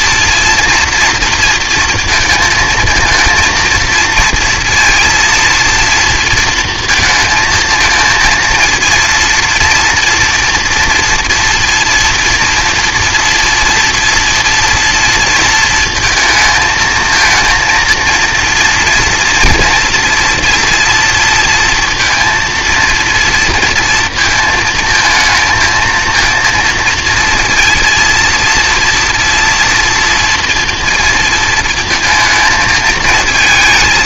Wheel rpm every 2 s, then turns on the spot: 230, 230, 230, 230, 230, 240, 230, 240, 220, 230, 230, 230, 230, 230, 230, 230, 220.
none